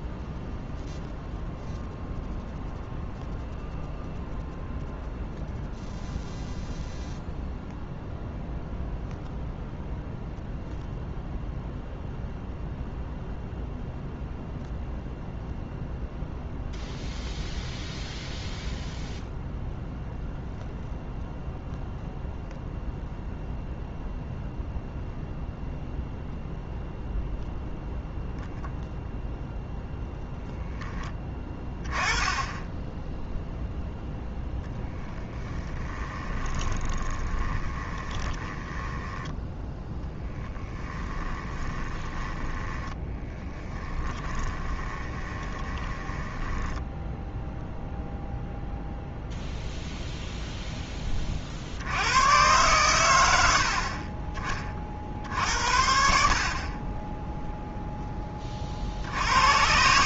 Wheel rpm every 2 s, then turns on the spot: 0, 0, 0, 0, 0, 0, 0, 0, 0, 0, 0, 0, 0, 0, 0, 10, 10, 10, 20, 10, 10, 10, 20, 10, 0, 10, 120, 30, 30, 40.
36-48